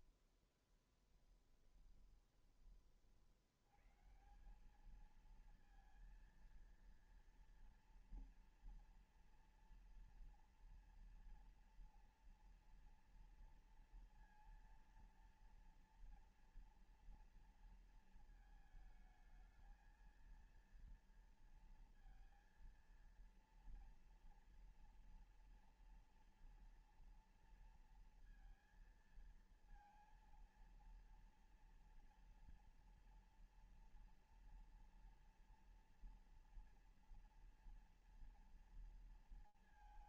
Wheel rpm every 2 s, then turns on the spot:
20, 30, 190, 230, 230, 230, 230, 230, 230, 220, 230, 230, 230, 230, 230, 230, 230, 230, 230, 230.
0-2